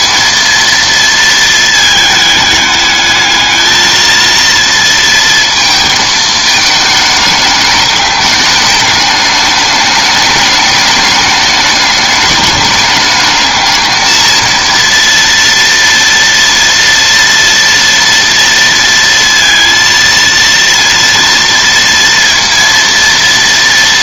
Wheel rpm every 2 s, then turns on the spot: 230, 210, 230, 210, 210, 210, 210, 230, 230, 230, 230, 230.
none